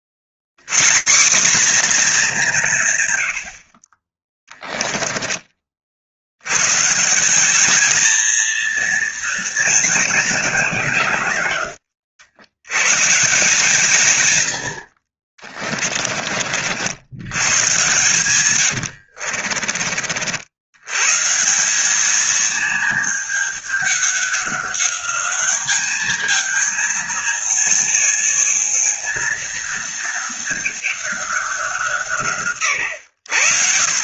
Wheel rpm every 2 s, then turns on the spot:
150, 150, 20, 150, 230, 170, 150, 50, 90, 60, 140, 210, 200, 220, 230, 210, 90.
4-6 18-20